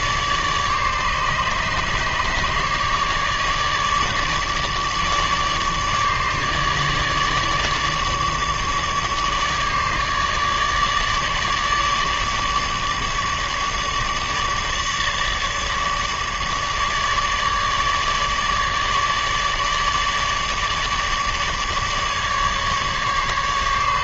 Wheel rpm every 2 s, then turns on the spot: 150, 150, 150, 150, 150, 150, 150, 150, 150, 150, 150, 150.
none